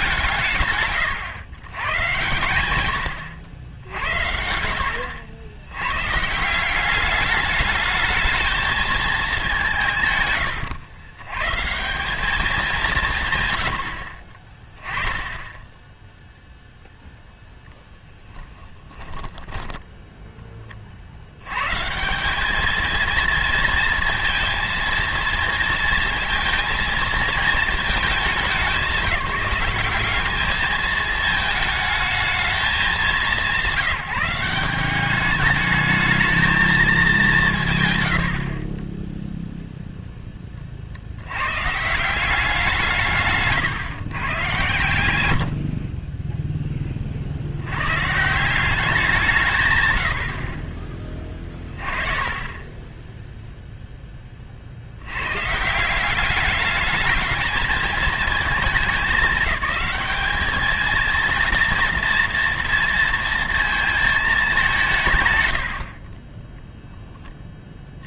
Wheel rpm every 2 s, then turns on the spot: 150, 110, 90, 190, 220, 80, 200, 20, 0, 10, 20, 200, 230, 230, 200, 210, 200, 180, 220, 30, 30, 170, 120, 10, 180, 30, 10, 50, 210, 210, 220, 230, 170, 10.
38-40